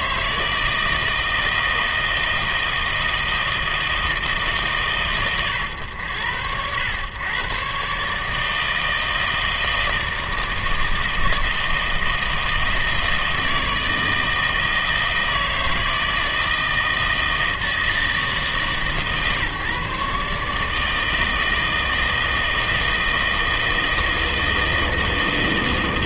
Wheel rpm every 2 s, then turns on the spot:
160, 160, 140, 100, 160, 160, 160, 160, 160, 150, 150, 160, 160.
none